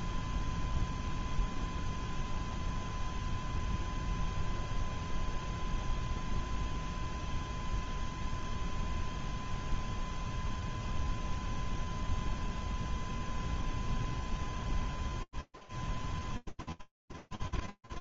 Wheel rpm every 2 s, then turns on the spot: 0, 0, 0, 0, 0, 0, 0, 0, 0.
none